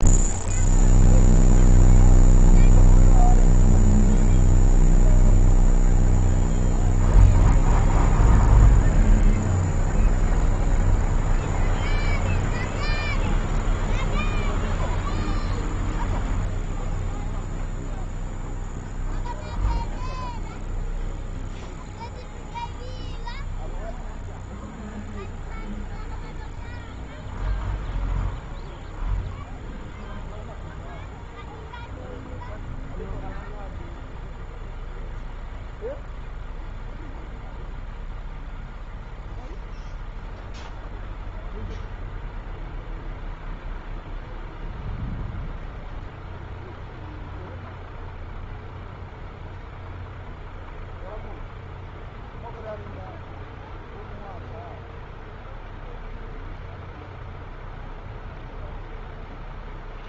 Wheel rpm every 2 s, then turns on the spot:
0, 0, 0, 0, 0, 0, 0, 0, 0, 0, 0, 0, 0, 0, 0, 0, 0, 0, 0, 0, 0, 0, 0, 0, 0, 0, 0, 0, 0, 0.
none